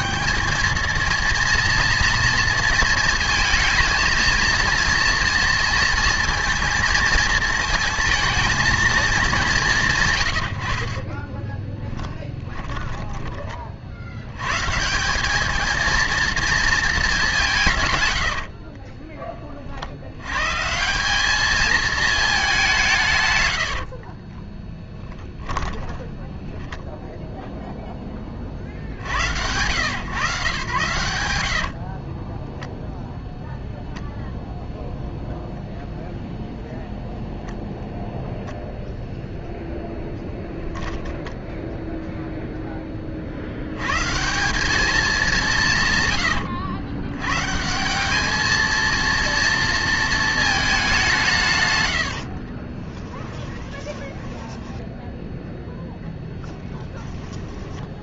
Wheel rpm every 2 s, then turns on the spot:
220, 230, 230, 230, 220, 90, 10, 150, 220, 20, 160, 180, 10, 0, 10, 120, 0, 0, 0, 0, 0, 10, 200, 110, 230, 210, 30, 10, 10.
12-14 18-20 24-26 52-58